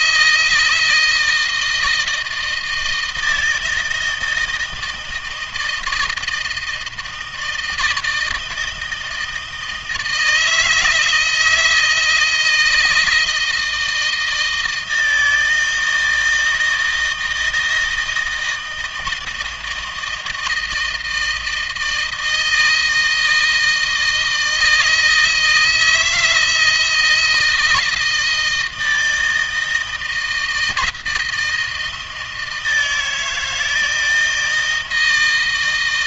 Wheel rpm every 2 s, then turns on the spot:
160, 160, 160, 160, 160, 160, 170, 160, 160, 160, 160, 160, 160, 160, 160, 160, 160, 160.
none